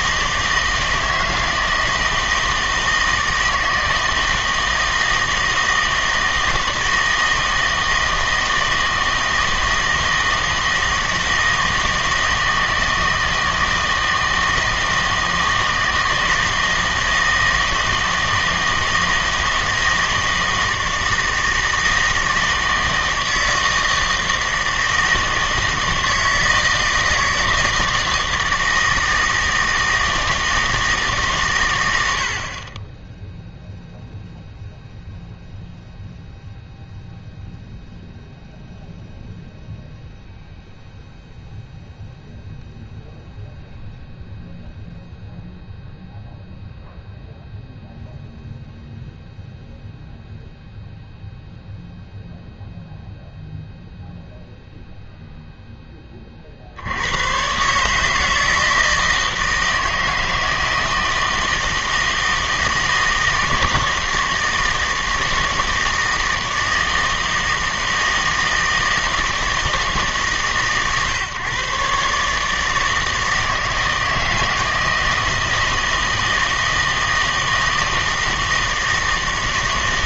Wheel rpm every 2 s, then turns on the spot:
160, 160, 160, 160, 160, 160, 160, 160, 160, 160, 160, 160, 160, 160, 160, 160, 30, 0, 0, 0, 0, 0, 0, 0, 0, 0, 0, 0, 60, 160, 160, 160, 160, 160, 160, 140, 160, 160, 160, 160.
none